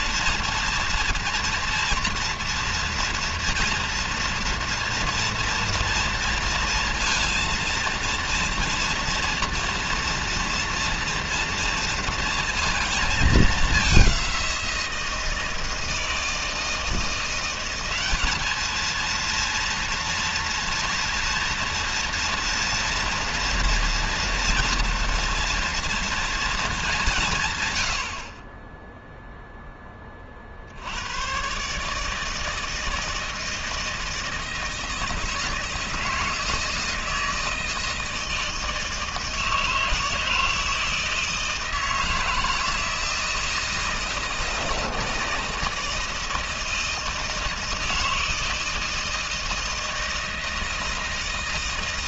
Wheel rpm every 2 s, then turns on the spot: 230, 230, 230, 230, 230, 230, 230, 180, 160, 210, 230, 230, 230, 220, 30, 50, 160, 160, 160, 160, 160, 160, 160, 160, 160, 160.
none